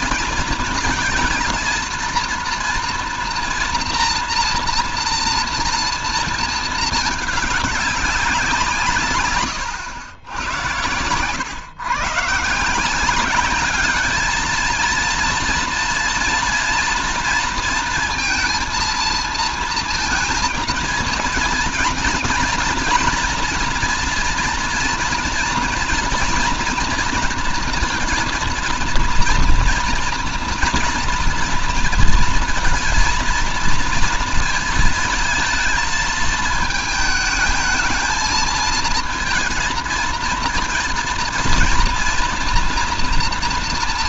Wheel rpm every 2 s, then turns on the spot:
230, 230, 230, 220, 180, 100, 160, 230, 230, 230, 230, 240, 230, 240, 230, 230, 230, 230, 220, 220, 230, 230.
none